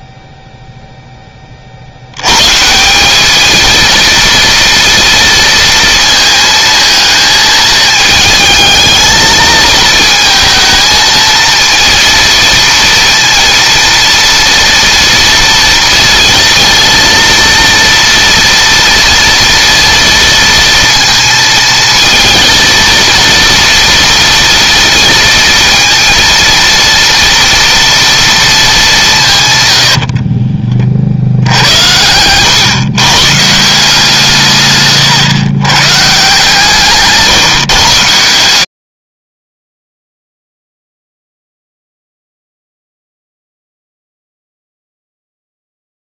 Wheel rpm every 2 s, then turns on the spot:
0, 180, 230, 220, 220, 220, 230, 230, 230, 230, 230, 230, 230, 230, 200, 30, 120, 140, 150, 100, 0, 0, 0.
34-36